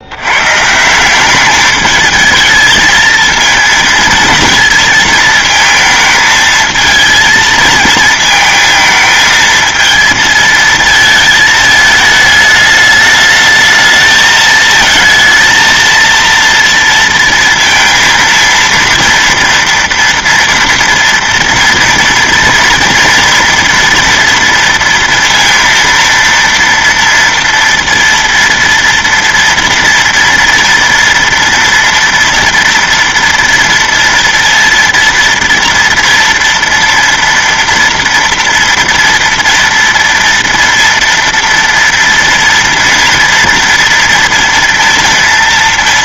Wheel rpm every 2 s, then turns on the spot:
140, 220, 230, 220, 220, 220, 210, 220, 230, 230, 230, 230, 230, 230, 230, 230, 230, 230, 230, 230, 230, 230, 230.
none